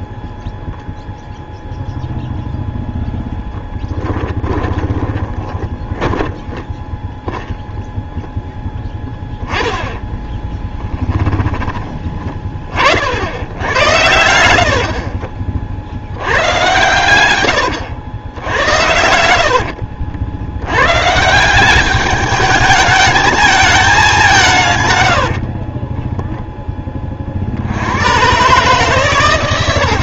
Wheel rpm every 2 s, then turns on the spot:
0, 0, 20, 10, 0, 10, 40, 90, 100, 90, 100, 210, 150, 10, 130.
4-8 10-12 18-20